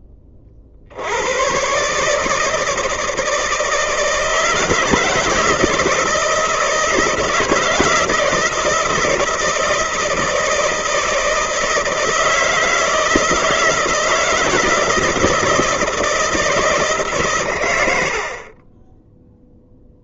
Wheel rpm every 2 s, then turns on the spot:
60, 150, 160, 160, 160, 160, 160, 160, 150, 20.
none